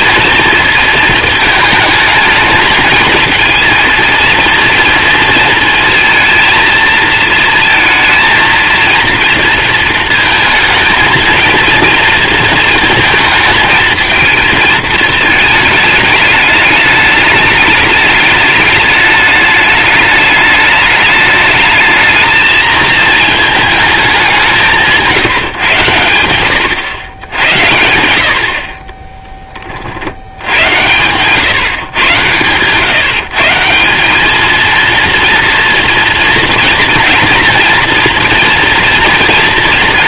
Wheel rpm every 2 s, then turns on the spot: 230, 220, 230, 230, 230, 220, 230, 220, 210, 210, 210, 220, 180, 110, 50, 100, 130, 220, 240, 230.
none